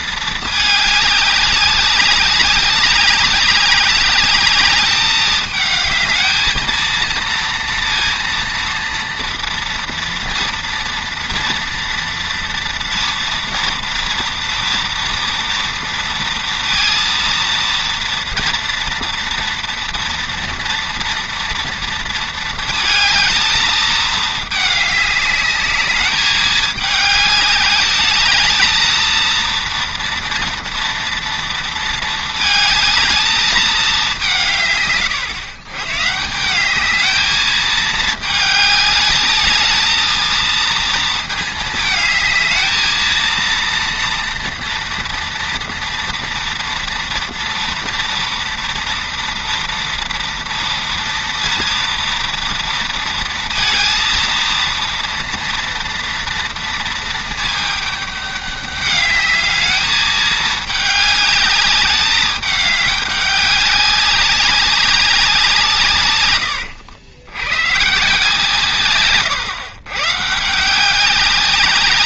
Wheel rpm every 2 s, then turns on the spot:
210, 200, 210, 230, 230, 230, 230, 230, 230, 230, 230, 220, 210, 210, 220, 230, 220, 150, 180, 210, 230, 220, 230, 230, 230, 230, 230, 230, 230, 200, 210, 210, 200, 100, 160, 160.
66-68